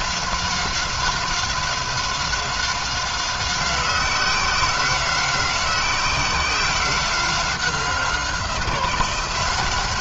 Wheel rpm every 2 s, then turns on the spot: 190, 190, 180, 190, 180.
none